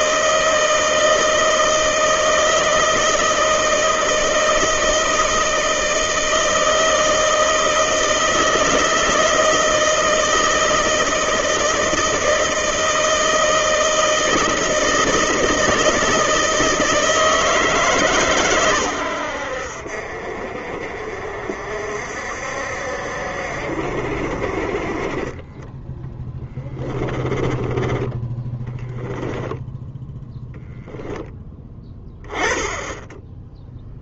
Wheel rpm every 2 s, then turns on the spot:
160, 160, 160, 160, 160, 160, 160, 160, 160, 110, 50, 60, 40, 20, 10, 10, 10.
26-32